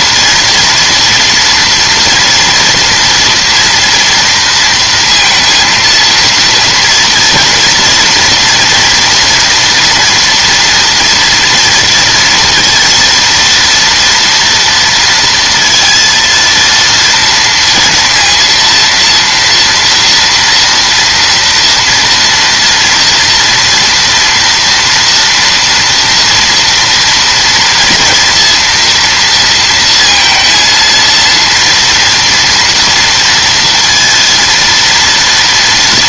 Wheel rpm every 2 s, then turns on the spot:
230, 230, 230, 230, 230, 230, 230, 230, 230, 230, 230, 230, 240, 230, 230, 230, 230, 230.
none